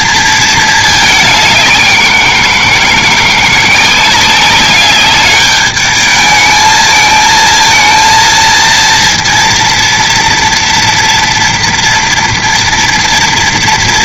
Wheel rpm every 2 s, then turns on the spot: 220, 170, 200, 220, 230, 230, 230.
none